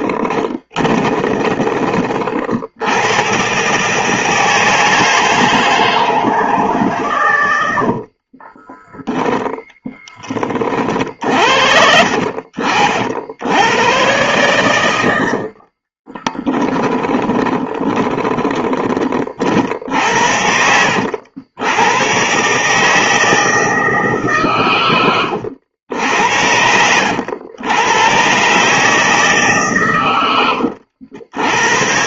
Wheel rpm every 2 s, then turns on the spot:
20, 90, 160, 130, 10, 50, 80, 90, 20, 40, 80, 160, 100, 90, 150, 90.
0-2 8-12 14-18